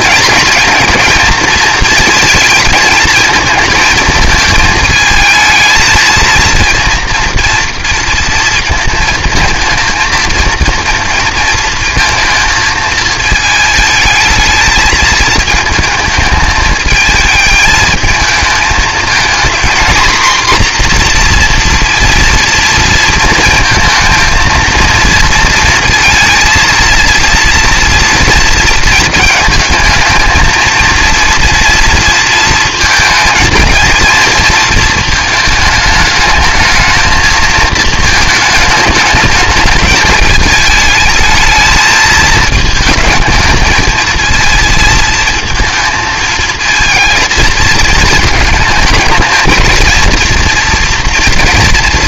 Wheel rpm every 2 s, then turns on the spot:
230, 220, 220, 230, 220, 230, 220, 220, 220, 220, 250, 230, 230, 230, 230, 230, 230, 230, 220, 210, 220, 220, 230, 230, 220, 230.
none